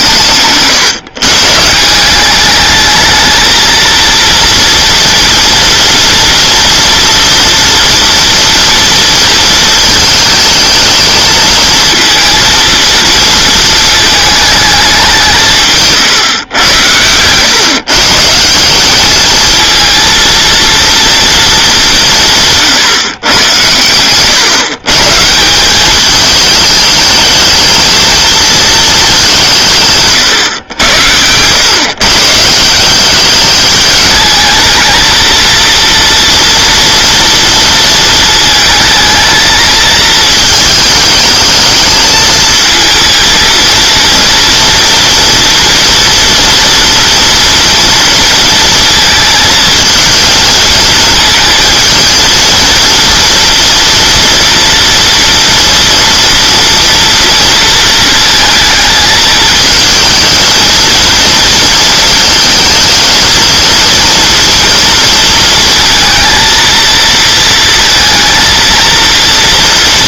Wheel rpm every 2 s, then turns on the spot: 140, 210, 230, 230, 230, 220, 230, 210, 100, 190, 230, 130, 140, 220, 220, 110, 190, 220, 230, 220, 220, 220, 230, 240, 230, 220, 230, 230, 230, 220, 220, 230, 230, 230, 230.
30-32